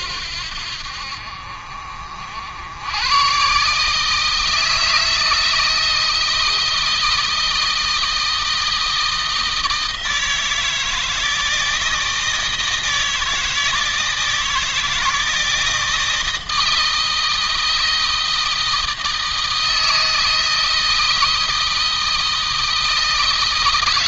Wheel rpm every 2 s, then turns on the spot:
70, 100, 160, 160, 160, 160, 160, 160, 160, 160, 160, 160.
none